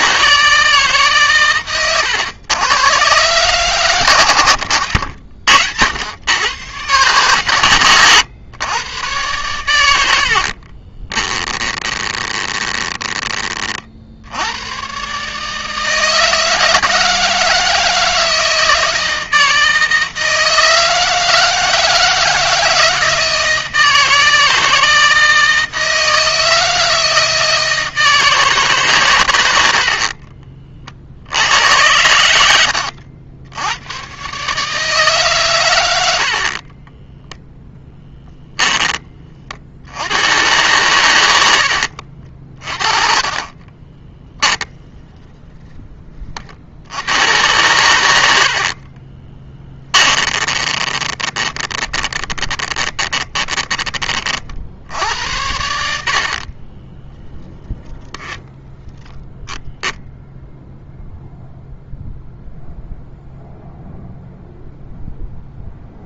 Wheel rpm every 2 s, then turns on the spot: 150, 110, 80, 140, 110, 40, 20, 120, 160, 160, 160, 160, 160, 160, 140, 40, 80, 150, 20, 20, 110, 40, 10, 70, 40, 20, 20, 60, 20, 10, 0, 0, 0.
10-14 32-34 36-38 42-46 48-54 56-58